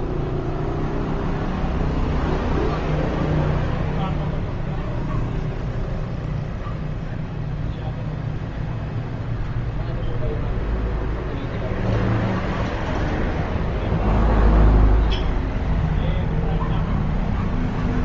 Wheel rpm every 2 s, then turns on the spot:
0, 0, 0, 0, 0, 0, 0, 0, 0.
none